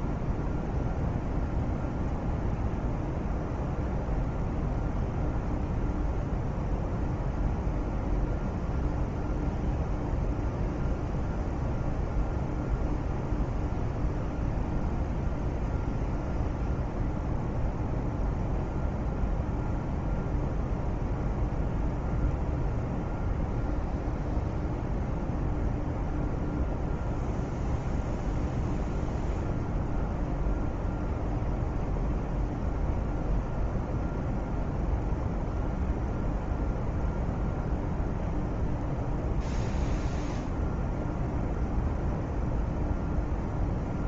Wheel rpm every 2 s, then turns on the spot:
0, 0, 0, 0, 0, 0, 0, 0, 0, 0, 0, 0, 0, 0, 0, 0, 0, 0, 0, 0, 0, 0.
none